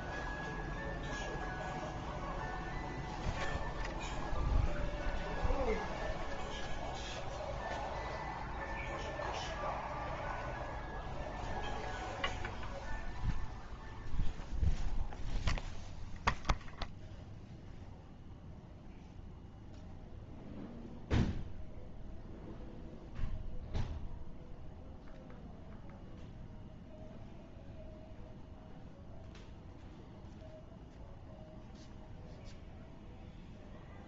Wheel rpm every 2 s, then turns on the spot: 0, 0, 0, 0, 0, 0, 0, 0, 0, 0, 0, 0, 0, 0, 0, 0, 0.
none